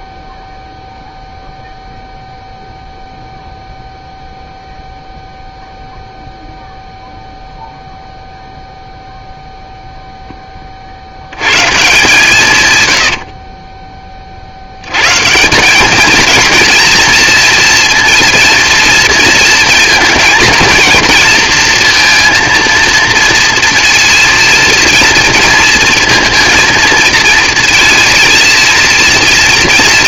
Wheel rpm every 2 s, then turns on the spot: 0, 0, 0, 0, 0, 100, 50, 150, 240, 230, 230, 230, 230, 230, 230.
12-14